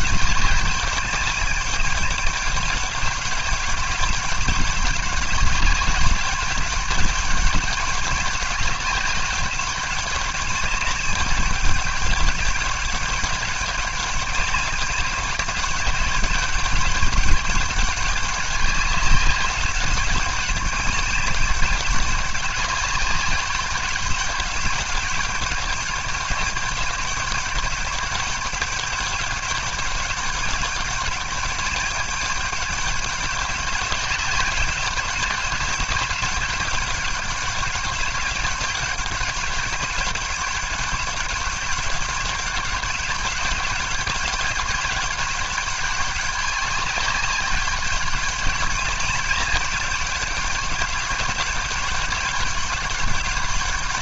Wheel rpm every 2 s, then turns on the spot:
200, 200, 200, 200, 190, 200, 190, 200, 210, 190, 200, 200, 200, 200, 200, 200, 200, 200, 200, 200, 200, 200, 200, 200, 200, 200, 200.
none